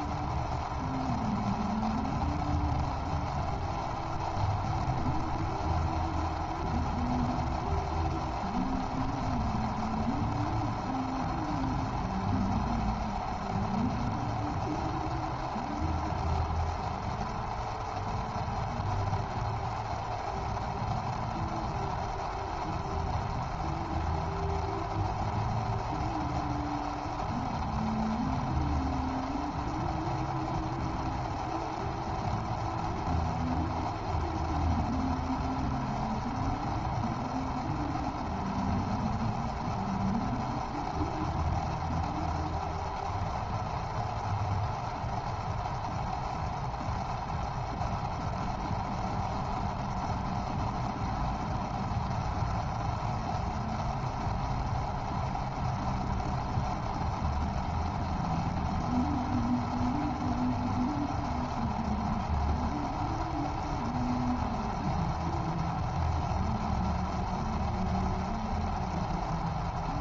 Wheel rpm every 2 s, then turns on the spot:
0, 0, 0, 0, 0, 0, 0, 0, 0, 0, 0, 0, 0, 0, 0, 0, 0, 0, 0, 0, 0, 0, 0, 0, 0, 0, 0, 0, 0, 0, 0, 0, 0, 0, 0.
none